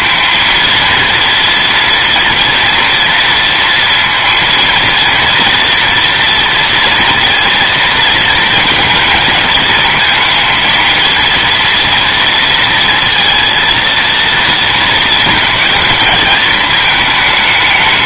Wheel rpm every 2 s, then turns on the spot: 230, 240, 230, 230, 230, 230, 230, 230, 210.
none